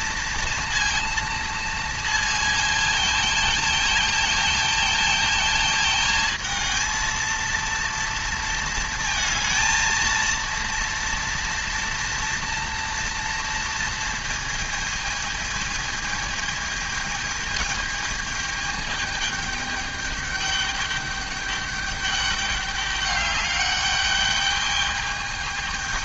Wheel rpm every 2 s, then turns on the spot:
230, 220, 220, 230, 230, 230, 230, 220, 220, 210, 210, 200, 210.
none